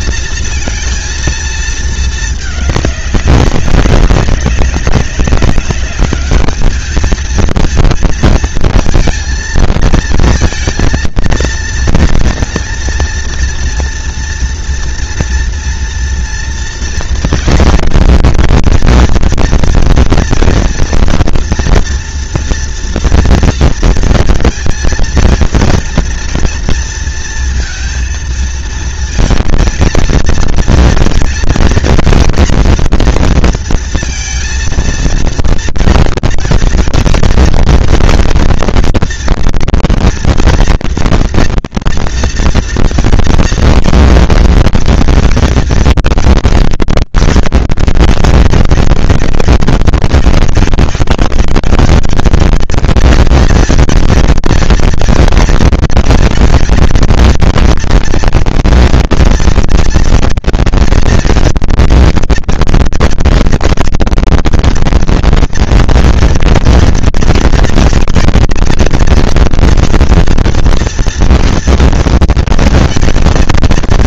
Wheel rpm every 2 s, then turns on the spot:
230, 210, 200, 210, 230, 230, 230, 230, 230, 230, 240, 240, 230, 230, 220, 230, 230, 230, 230, 230, 230, 230, 230, 220, 200, 200, 220, 230, 220, 230, 230, 230, 230, 230, 220, 230, 230.
none